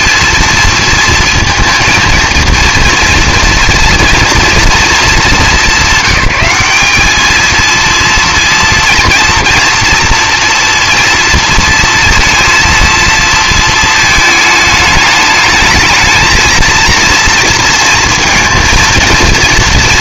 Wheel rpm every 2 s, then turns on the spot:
230, 230, 220, 200, 230, 230, 230, 220, 230, 230.
none